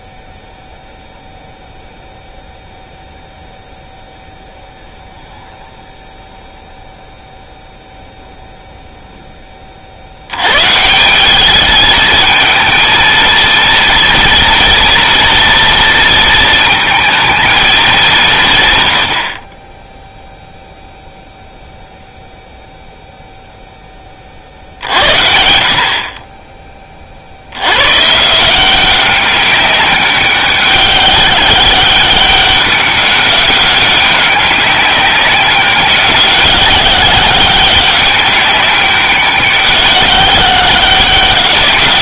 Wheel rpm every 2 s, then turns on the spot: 0, 0, 0, 0, 0, 140, 220, 230, 230, 130, 0, 0, 60, 30, 180, 200, 200, 190, 190, 190, 190.
none